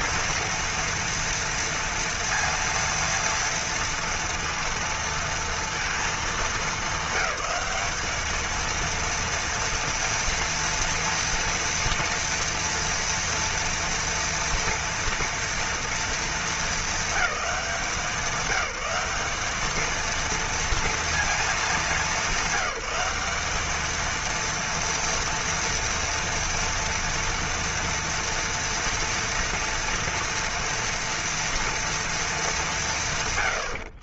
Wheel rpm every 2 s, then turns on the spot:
230, 230, 230, 220, 210, 230, 230, 230, 220, 190, 230, 200, 230, 240, 230, 230, 220.
none